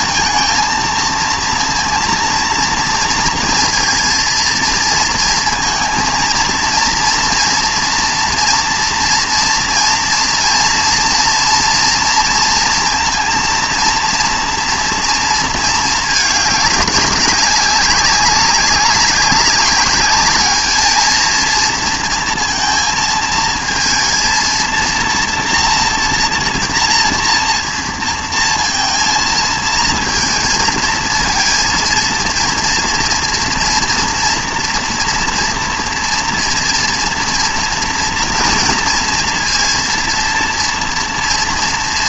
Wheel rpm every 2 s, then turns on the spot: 230, 230, 230, 230, 230, 230, 230, 230, 200, 200, 210, 230, 230, 230, 230, 230, 230, 240, 230, 230, 230.
none